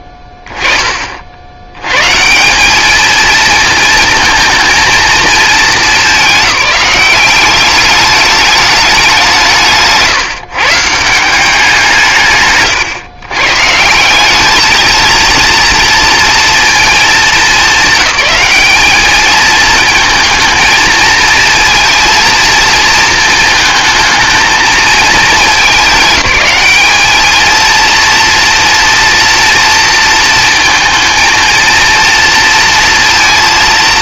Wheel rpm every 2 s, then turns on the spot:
10, 200, 230, 200, 210, 160, 140, 220, 220, 200, 220, 230, 220, 210, 230, 230, 230.
none